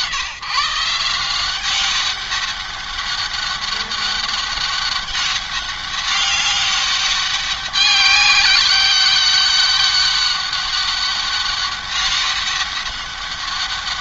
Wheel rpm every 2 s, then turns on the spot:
180, 200, 200, 200, 200, 190, 190.
none